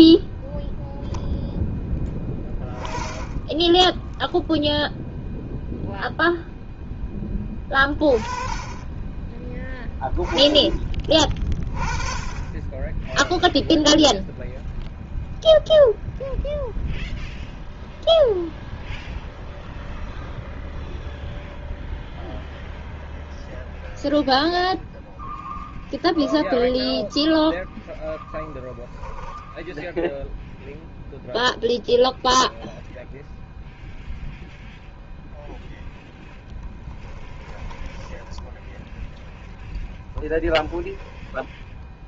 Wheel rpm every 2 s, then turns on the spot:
0, 10, 0, 10, 10, 20, 10, 0, 0, 0, 0, 0, 0, 0, 10, 0, 0, 0, 20, 10, 10.
36-38 40-42